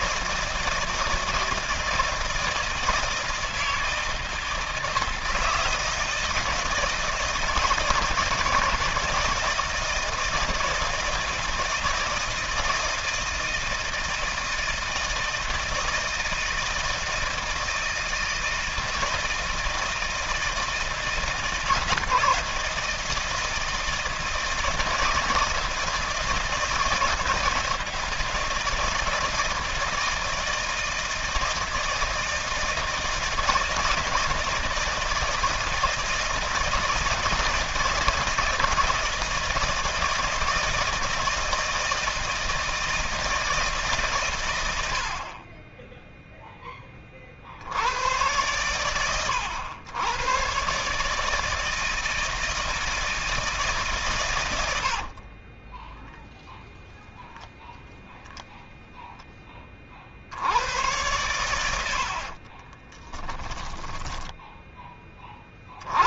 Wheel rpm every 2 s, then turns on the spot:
160, 160, 160, 160, 160, 160, 160, 160, 160, 160, 160, 160, 160, 160, 160, 160, 160, 160, 160, 160, 160, 160, 60, 20, 120, 140, 160, 50, 0, 0, 100, 20, 20.
54-56 62-64